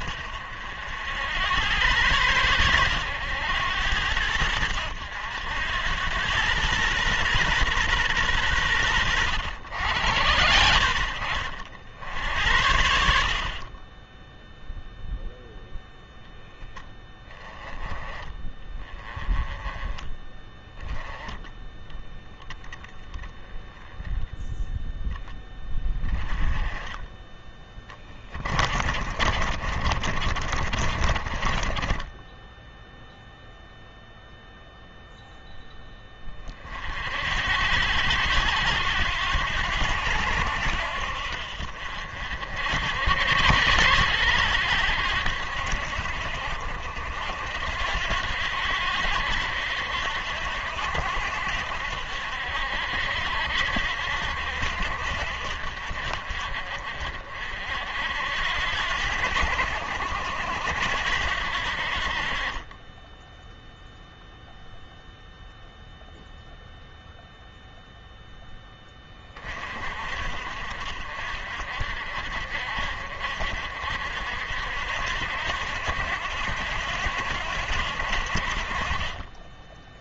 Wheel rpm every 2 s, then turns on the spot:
80, 100, 90, 120, 100, 70, 70, 0, 10, 20, 10, 10, 10, 20, 40, 40, 0, 0, 50, 90, 70, 70, 80, 60, 80, 70, 70, 60, 50, 80, 80, 20, 0, 0, 20, 50, 50, 70, 80, 40.
28-32